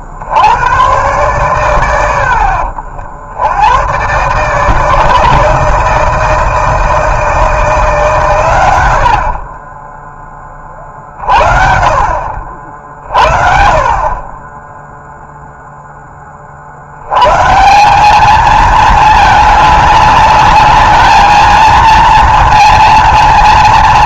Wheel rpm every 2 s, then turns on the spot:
60, 70, 130, 160, 130, 30, 60, 20, 70, 220, 210, 230.
none